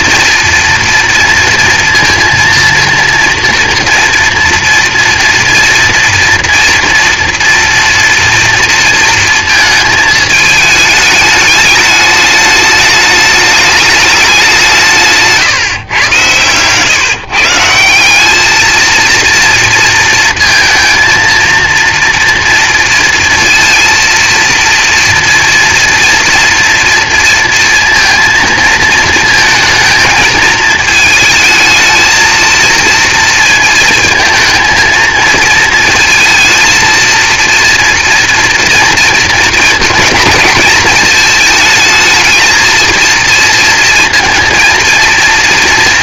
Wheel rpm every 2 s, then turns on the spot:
230, 230, 230, 240, 230, 220, 210, 190, 120, 210, 230, 230, 230, 230, 230, 220, 230, 220, 230, 230, 220, 220, 230.
none